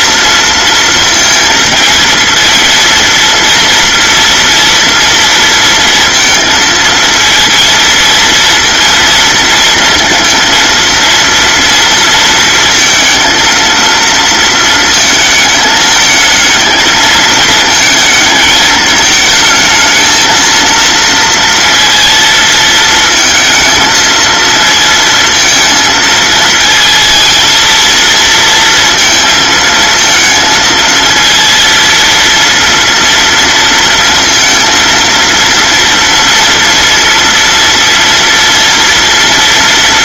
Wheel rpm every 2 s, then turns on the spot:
230, 230, 230, 230, 230, 230, 230, 220, 220, 210, 230, 230, 230, 230, 230, 230, 230, 230, 230, 230.
none